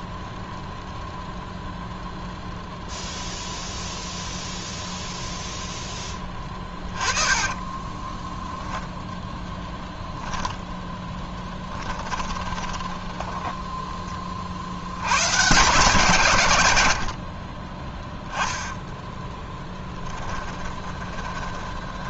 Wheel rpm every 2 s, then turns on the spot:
0, 0, 0, 20, 0, 10, 20, 60, 100, 10, 20.
6-8 10-14 18-22